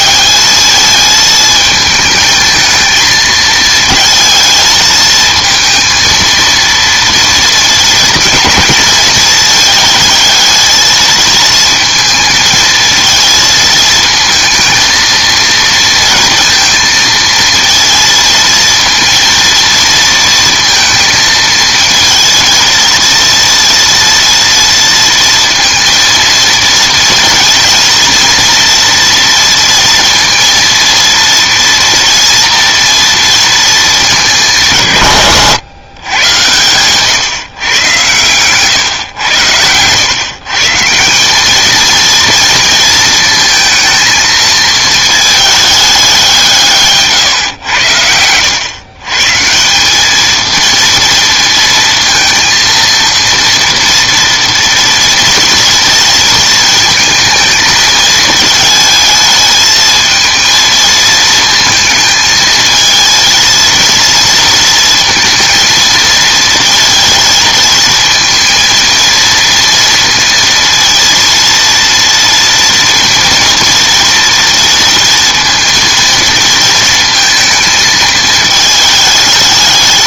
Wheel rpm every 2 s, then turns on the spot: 220, 220, 220, 230, 230, 220, 220, 230, 230, 230, 230, 230, 230, 230, 230, 230, 230, 170, 120, 120, 150, 230, 220, 160, 110, 230, 230, 230, 220, 220, 220, 220, 230, 230, 230, 230, 230, 230, 230, 220.
none